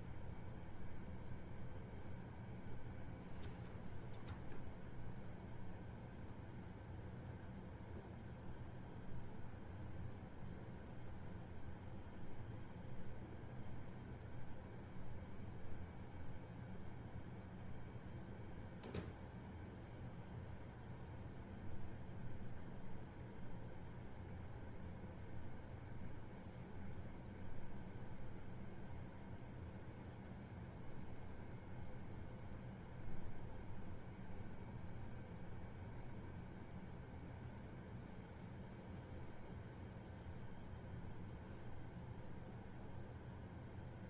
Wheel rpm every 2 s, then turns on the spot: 0, 0, 0, 0, 0, 0, 0, 0, 0, 0, 0, 0, 0, 0, 0, 0, 0, 0, 0, 0, 0, 0.
none